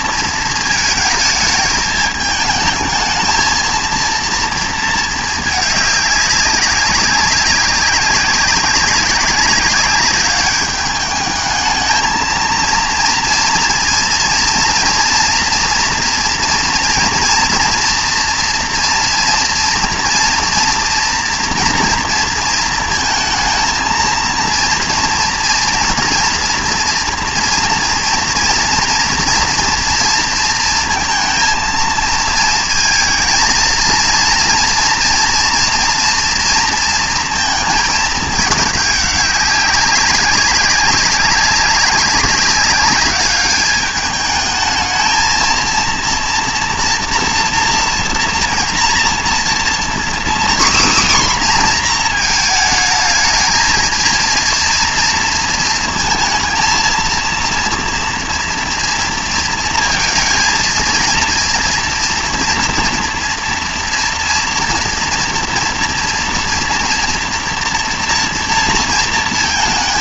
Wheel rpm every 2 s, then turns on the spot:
220, 220, 230, 200, 190, 200, 230, 230, 230, 240, 230, 230, 230, 230, 230, 230, 220, 230, 230, 210, 200, 200, 210, 230, 230, 260, 220, 230, 230, 230, 230, 230, 230, 240, 230.
none